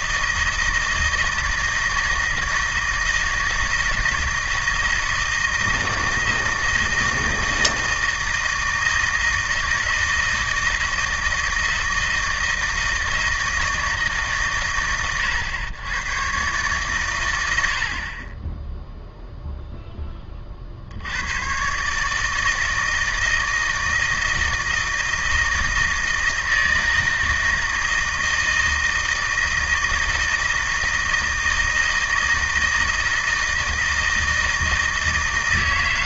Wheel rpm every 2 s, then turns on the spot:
160, 160, 160, 160, 160, 160, 160, 120, 130, 10, 50, 160, 160, 160, 160, 160, 160, 160.
none